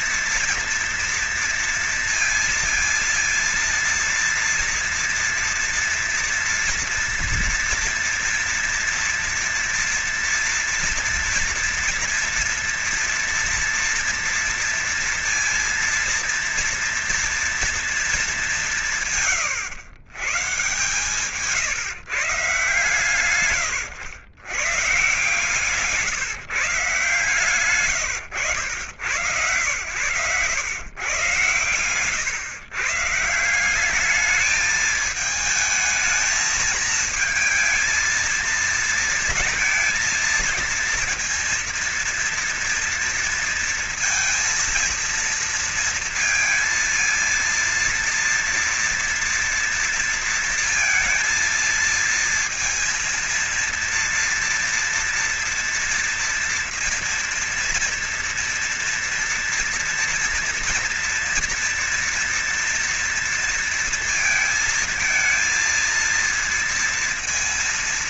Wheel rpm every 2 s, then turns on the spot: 230, 230, 230, 230, 230, 230, 230, 230, 230, 200, 130, 140, 120, 140, 90, 110, 130, 210, 220, 230, 230, 230, 230, 230, 230, 230, 230, 230, 230, 230, 230, 240, 230, 230.
none